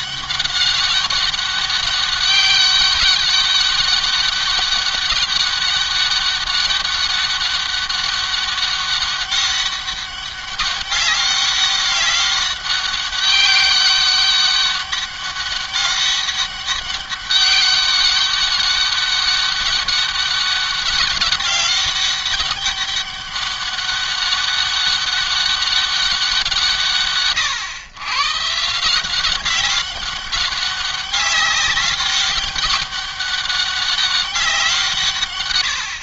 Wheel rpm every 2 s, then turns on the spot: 200, 200, 200, 200, 200, 200, 200, 200, 200, 200, 200, 200, 200, 170, 140, 200, 200, 180.
none